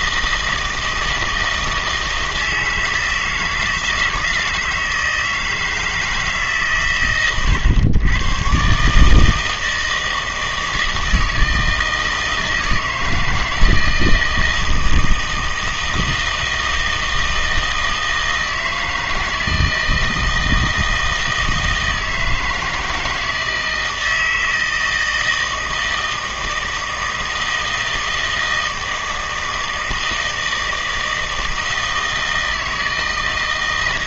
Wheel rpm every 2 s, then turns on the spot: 160, 160, 160, 150, 140, 160, 160, 160, 160, 160, 160, 160, 160, 160, 160, 160, 160.
none